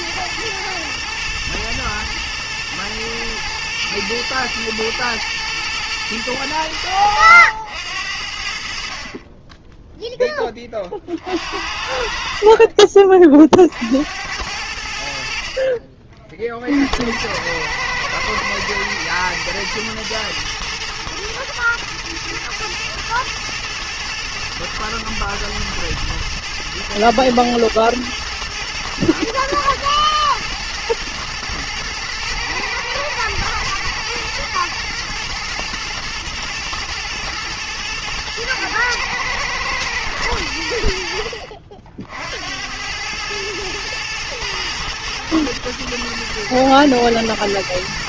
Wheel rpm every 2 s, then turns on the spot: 120, 110, 100, 50, 10, 40, 80, 40, 110, 110, 120, 110, 120, 110, 110, 110, 120, 120, 110, 110, 50, 110, 110, 110.
none